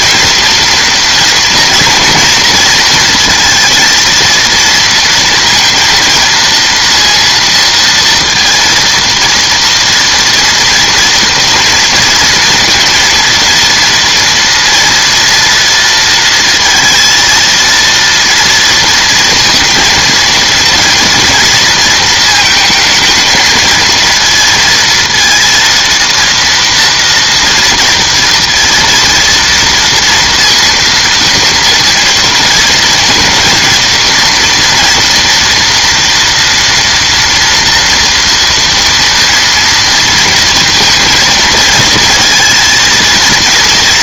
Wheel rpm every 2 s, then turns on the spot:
230, 230, 230, 230, 230, 230, 230, 230, 230, 230, 230, 220, 230, 230, 230, 230, 230, 240, 230, 230, 230, 220.
none